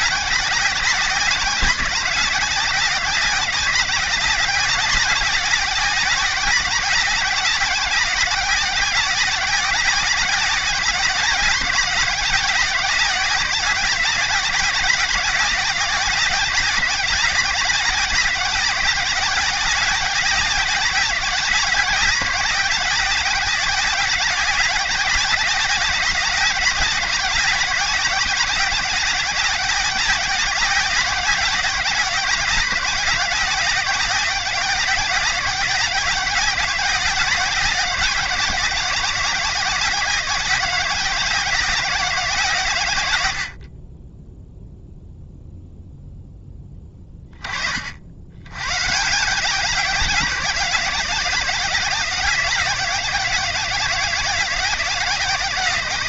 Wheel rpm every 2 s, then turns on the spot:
190, 190, 180, 190, 190, 180, 180, 190, 180, 190, 180, 180, 180, 190, 180, 180, 180, 180, 180, 180, 180, 120, 0, 10, 130, 170, 180, 180.
none